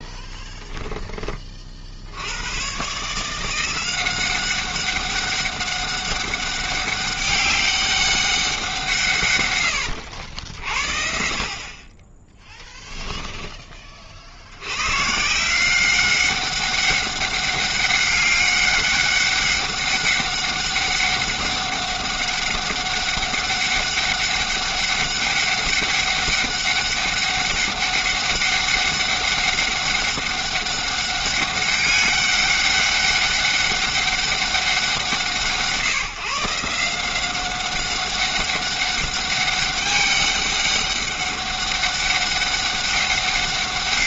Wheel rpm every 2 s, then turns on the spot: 10, 110, 190, 200, 180, 60, 10, 90, 200, 200, 200, 200, 200, 200, 200, 200, 200, 180, 160, 200, 200, 200.
0-2 12-14